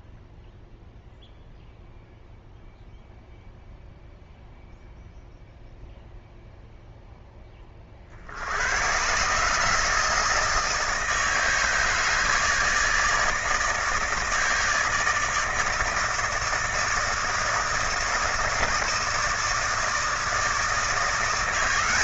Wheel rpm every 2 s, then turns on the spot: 0, 0, 0, 0, 100, 160, 160, 160, 160, 160, 160.
none